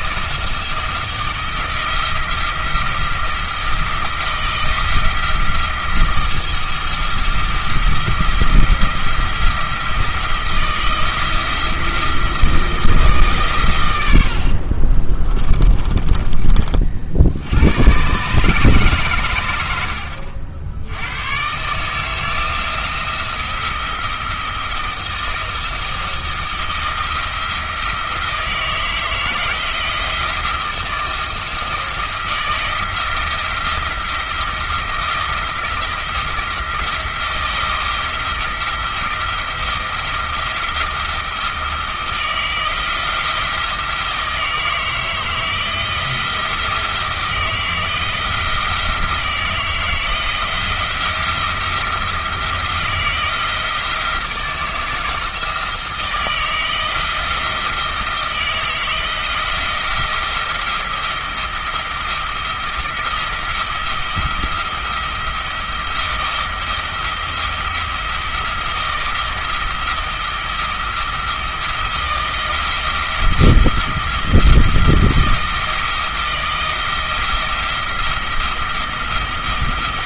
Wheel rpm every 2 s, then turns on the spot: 160, 170, 170, 170, 170, 170, 160, 50, 40, 140, 80, 170, 170, 170, 160, 170, 160, 170, 170, 170, 170, 170, 160, 170, 170, 170, 170, 160, 160, 160, 170, 170, 170, 170, 170, 170, 170, 170, 160, 170.
14-16